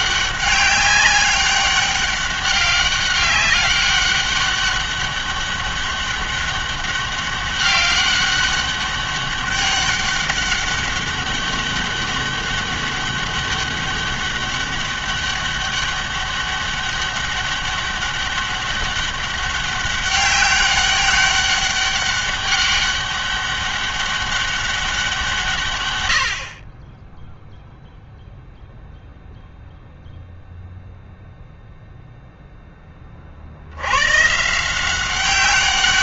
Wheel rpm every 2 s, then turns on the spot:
200, 200, 200, 200, 200, 200, 200, 200, 200, 200, 200, 200, 190, 50, 0, 0, 10, 160.
none